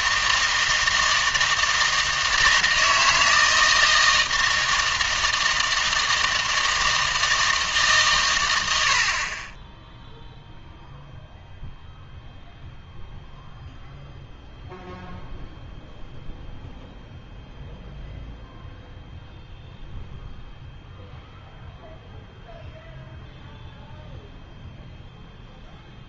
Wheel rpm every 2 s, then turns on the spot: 160, 160, 160, 160, 90, 0, 0, 0, 0, 0, 0, 0, 0.
none